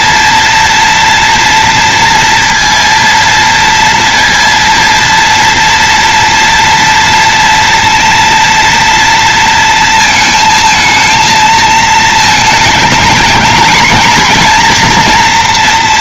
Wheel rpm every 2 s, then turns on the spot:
230, 230, 230, 230, 230, 220, 220, 230.
none